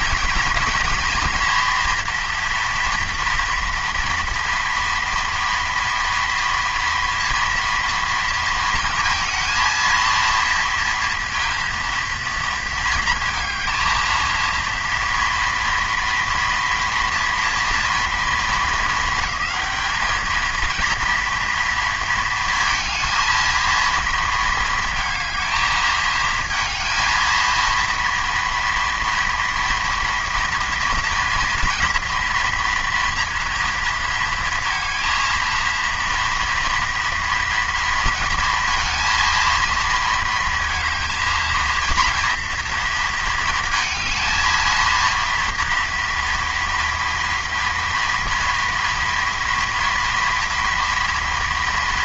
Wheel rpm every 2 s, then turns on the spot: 230, 230, 240, 230, 230, 230, 220, 230, 230, 220, 220, 230, 220, 220, 230, 230, 230, 230, 230, 230, 230, 230, 230, 230, 230, 230.
none